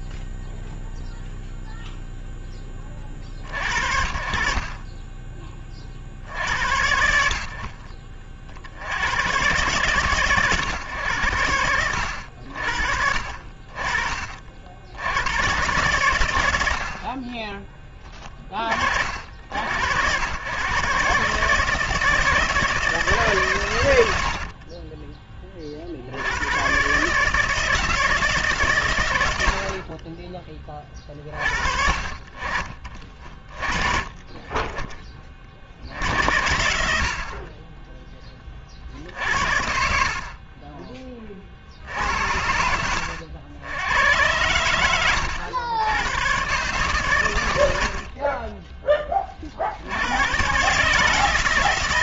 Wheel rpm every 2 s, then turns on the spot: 0, 40, 20, 60, 110, 100, 50, 80, 60, 50, 140, 150, 20, 140, 110, 30, 30, 20, 60, 50, 20, 80, 90, 130, 20, 150.
4-6 24-26